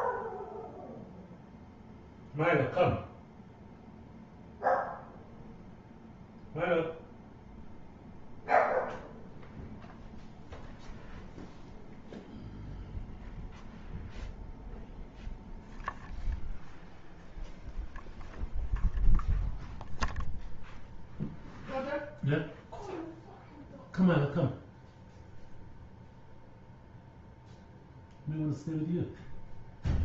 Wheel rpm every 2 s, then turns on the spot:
0, 0, 0, 0, 0, 0, 0, 0, 0, 0, 0, 0, 0, 0, 0.
none